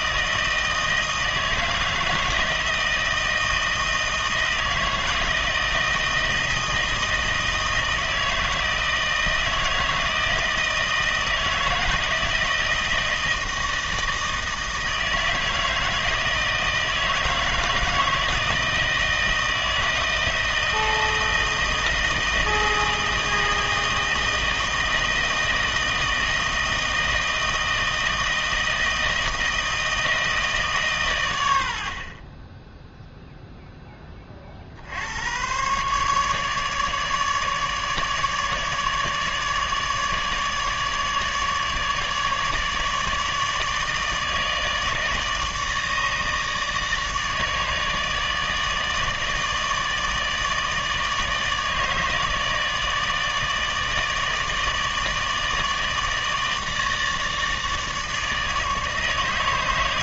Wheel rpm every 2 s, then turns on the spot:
160, 160, 160, 160, 160, 160, 160, 160, 160, 160, 160, 160, 160, 160, 160, 150, 10, 60, 150, 150, 150, 150, 160, 150, 150, 160, 160, 150, 160, 150.
none